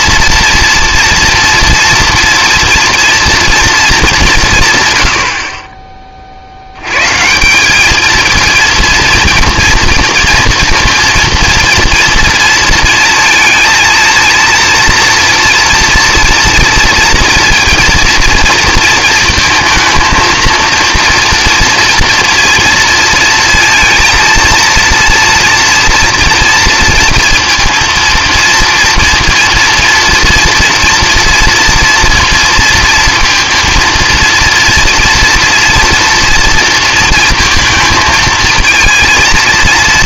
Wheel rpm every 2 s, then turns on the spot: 230, 240, 140, 90, 230, 230, 230, 230, 240, 230, 230, 230, 230, 230, 230, 230, 230, 230, 230, 230.
none